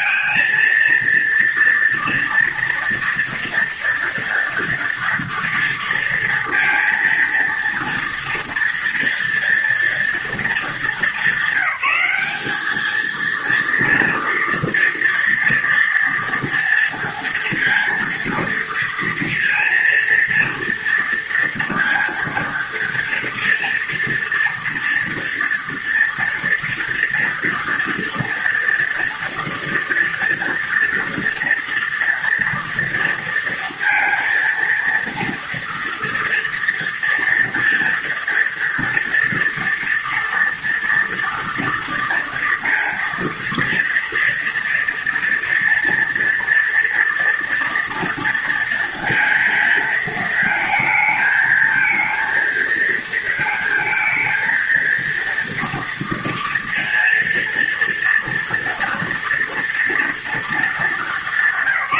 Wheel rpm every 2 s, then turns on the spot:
230, 230, 230, 230, 230, 220, 200, 230, 230, 230, 230, 230, 230, 230, 230, 230, 230, 230, 230, 240, 230, 230, 230, 230, 230, 220, 230, 230, 230, 230, 220.
none